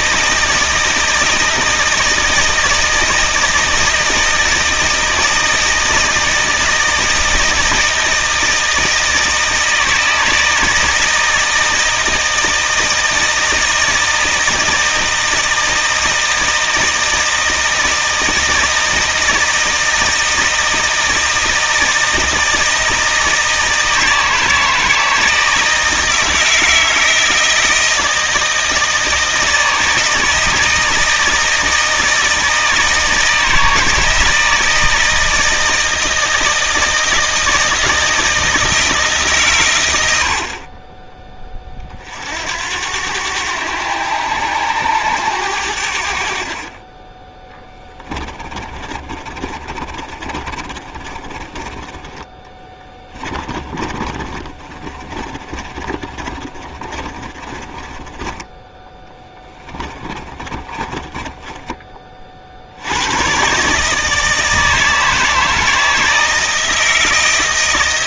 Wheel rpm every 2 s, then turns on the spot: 160, 160, 160, 160, 160, 160, 160, 160, 160, 160, 160, 160, 160, 160, 160, 160, 160, 160, 160, 160, 50, 80, 100, 40, 30, 40, 20, 30, 30, 10, 30, 60, 160, 160.
48-58 60-62